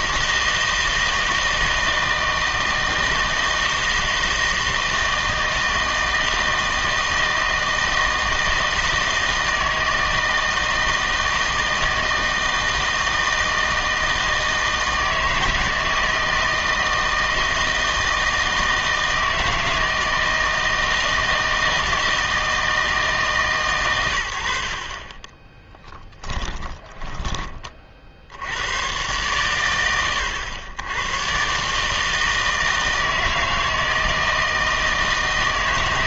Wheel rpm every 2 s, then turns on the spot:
160, 160, 160, 160, 160, 160, 160, 160, 160, 160, 160, 160, 40, 10, 100, 90, 160, 160.
24-28